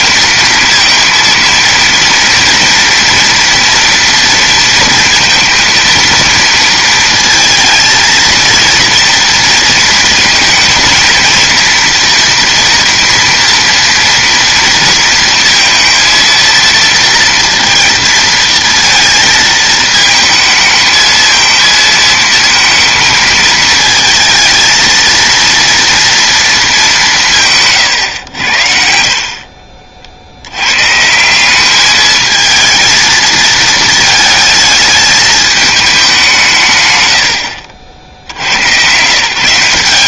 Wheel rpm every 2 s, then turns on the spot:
230, 230, 230, 230, 230, 230, 230, 230, 230, 230, 220, 230, 220, 220, 80, 100, 220, 220, 150, 90.
none